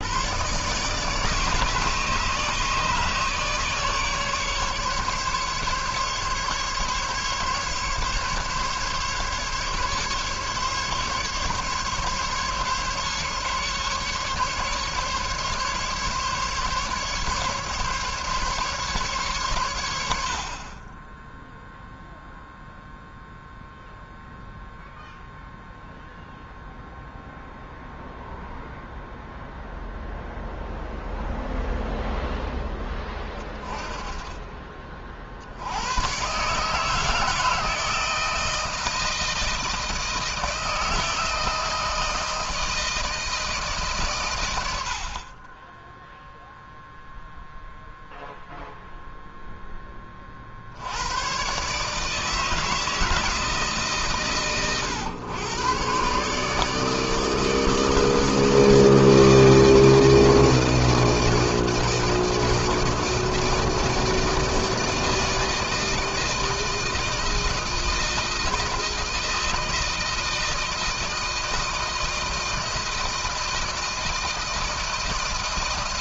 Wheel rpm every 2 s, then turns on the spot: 140, 150, 150, 140, 140, 140, 150, 140, 140, 130, 10, 0, 0, 0, 0, 0, 10, 50, 160, 160, 160, 160, 60, 0, 0, 100, 160, 120, 150, 160, 160, 160, 160, 160, 160, 160, 160, 160.
none